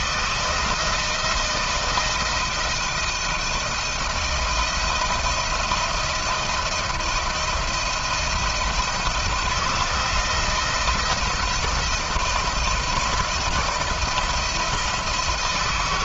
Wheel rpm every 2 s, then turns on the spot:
170, 170, 160, 160, 160, 170, 170, 170.
none